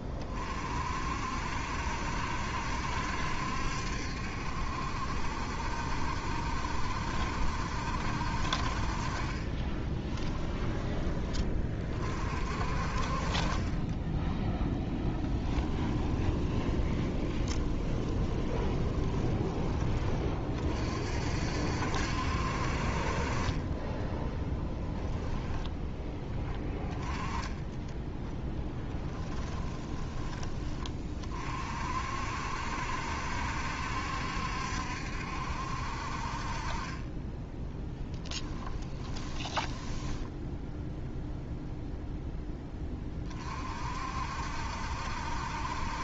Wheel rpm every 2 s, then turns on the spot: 50, 70, 70, 70, 50, 20, 50, 10, 20, 20, 40, 50, 10, 10, 10, 30, 60, 70, 40, 20, 0, 10, 60.
14-20 24-26 28-30 38-40